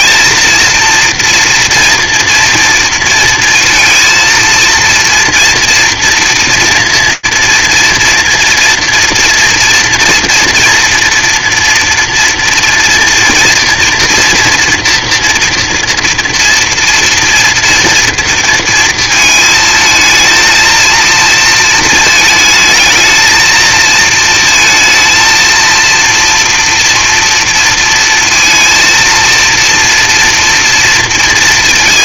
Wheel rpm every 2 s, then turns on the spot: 230, 230, 230, 230, 240, 230, 240, 240, 230, 230, 220, 220, 230, 240, 230, 230.
none